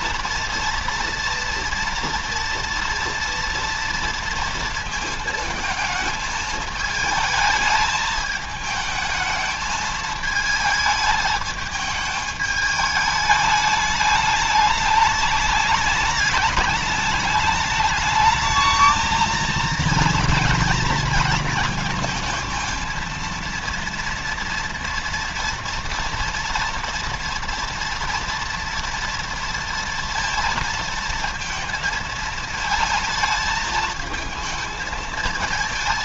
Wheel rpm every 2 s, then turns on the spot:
230, 230, 230, 220, 220, 220, 210, 210, 210, 220, 230, 230, 230, 230, 230, 230, 220, 220.
none